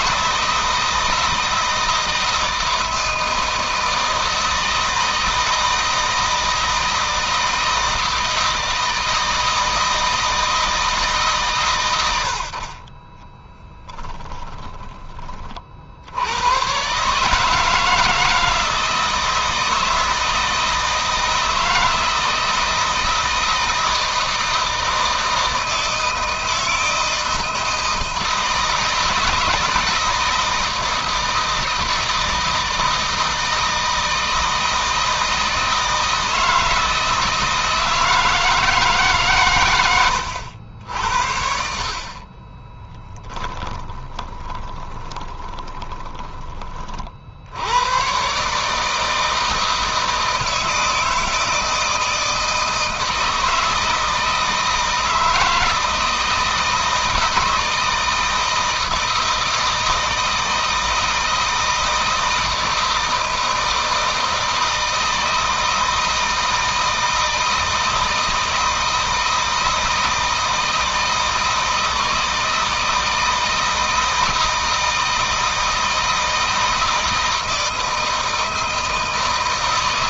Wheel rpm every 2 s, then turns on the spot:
160, 160, 160, 160, 160, 160, 40, 10, 120, 160, 160, 160, 160, 160, 160, 160, 160, 160, 160, 160, 70, 20, 20, 30, 150, 160, 160, 160, 160, 160, 160, 160, 160, 160, 160, 160, 160, 160, 160, 160.
42-46